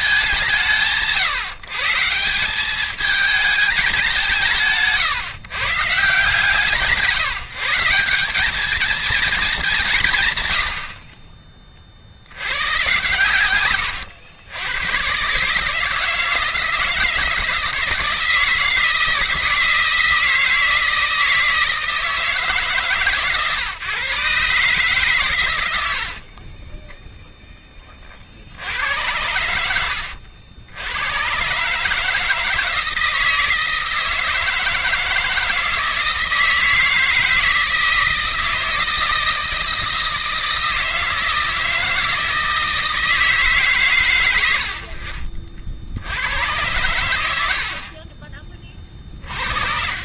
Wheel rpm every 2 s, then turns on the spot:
160, 200, 160, 170, 220, 70, 100, 110, 160, 160, 160, 150, 140, 20, 80, 90, 160, 160, 160, 160, 160, 160, 70, 100, 40.
none